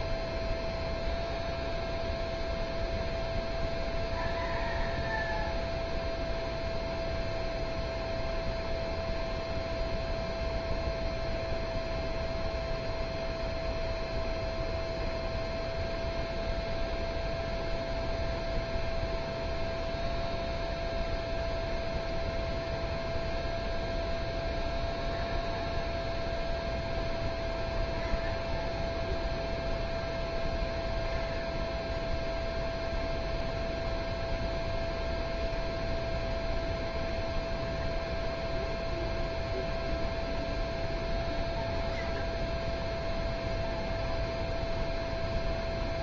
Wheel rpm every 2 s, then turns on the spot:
0, 0, 0, 0, 0, 0, 0, 0, 0, 0, 0, 0, 0, 0, 0, 0, 0, 0, 0, 0, 0, 0, 0.
none